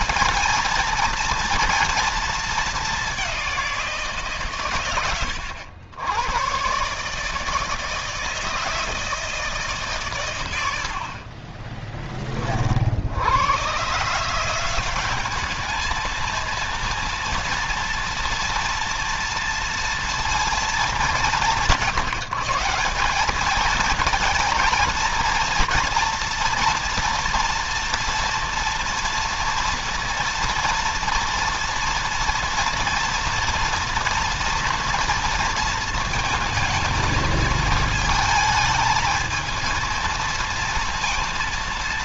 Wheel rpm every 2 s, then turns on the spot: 230, 200, 120, 140, 160, 50, 60, 190, 230, 230, 210, 190, 230, 240, 230, 230, 230, 230, 220, 220, 230.
none